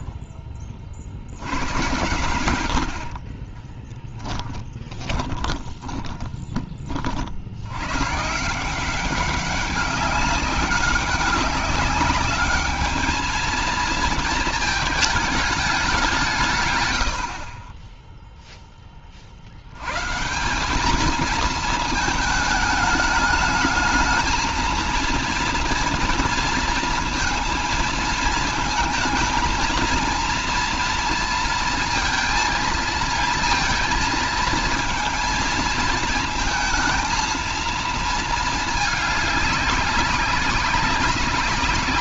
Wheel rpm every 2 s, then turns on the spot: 40, 90, 20, 30, 170, 200, 210, 220, 120, 20, 200, 210, 230, 230, 220, 230, 230, 220, 220, 220, 190.
4-6